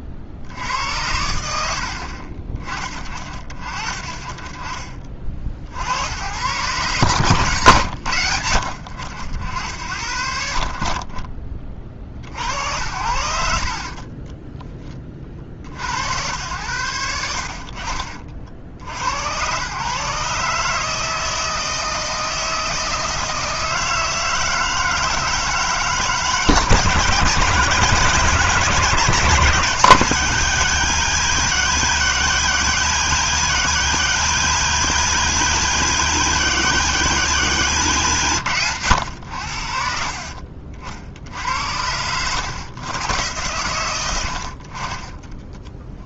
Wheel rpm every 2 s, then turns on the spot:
80, 30, 30, 120, 70, 60, 60, 20, 90, 60, 150, 160, 160, 160, 160, 170, 170, 170, 170, 120, 60, 120, 50.
none